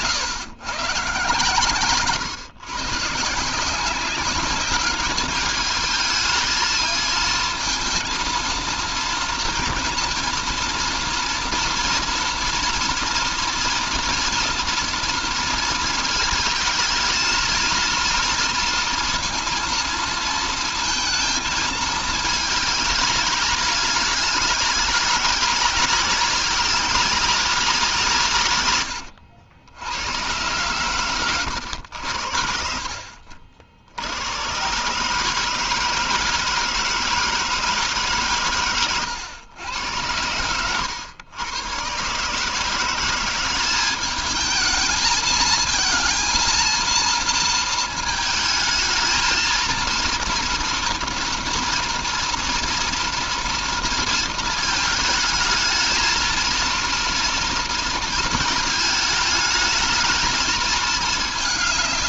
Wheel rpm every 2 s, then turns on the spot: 130, 140, 210, 220, 220, 230, 230, 230, 230, 230, 220, 220, 210, 190, 110, 110, 60, 150, 160, 120, 100, 180, 220, 230, 220, 230, 230, 220, 230, 220, 210.
none